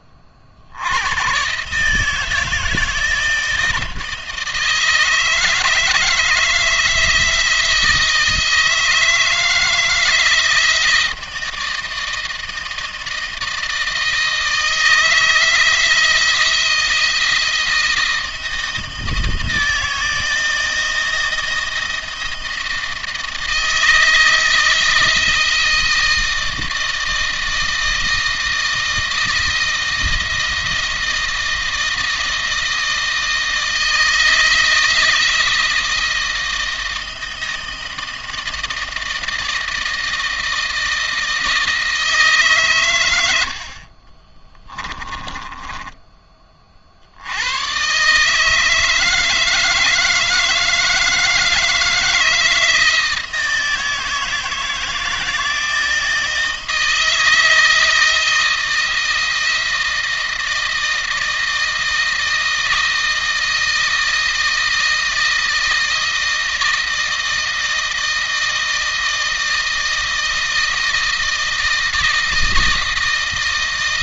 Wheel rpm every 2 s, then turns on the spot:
70, 160, 160, 170, 160, 160, 160, 160, 170, 170, 160, 160, 160, 160, 160, 160, 160, 160, 160, 160, 160, 130, 20, 50, 160, 160, 160, 160, 160, 160, 160, 160, 160, 160, 160, 160, 160.
44-46